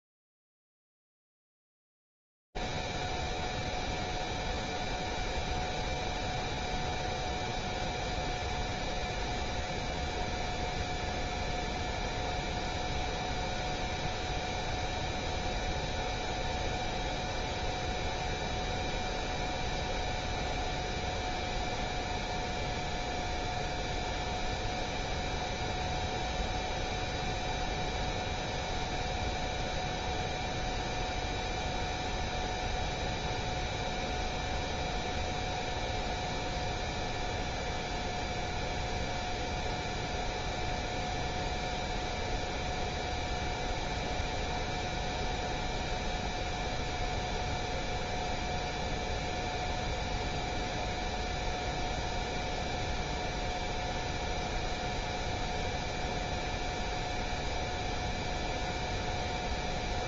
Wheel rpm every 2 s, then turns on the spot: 0, 0, 0, 0, 0, 0, 0, 0, 0, 0, 0, 0, 0, 0, 0, 0, 0, 0, 0, 0, 0, 0, 0, 0, 0, 0, 0, 0, 0, 0.
none